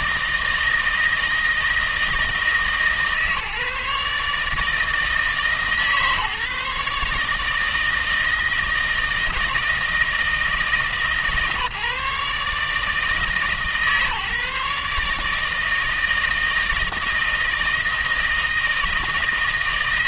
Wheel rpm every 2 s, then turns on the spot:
160, 150, 150, 140, 160, 160, 150, 150, 160, 160.
none